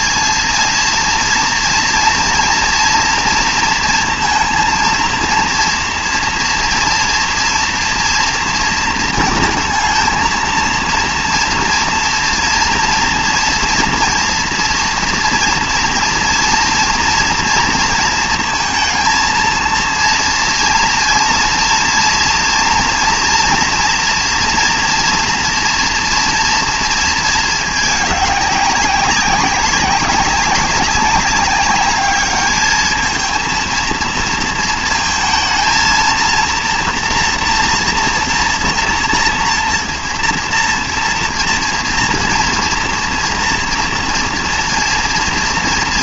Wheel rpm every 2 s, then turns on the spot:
230, 230, 230, 230, 230, 230, 230, 230, 230, 220, 230, 230, 230, 230, 200, 190, 210, 230, 230, 230, 230, 230, 230.
none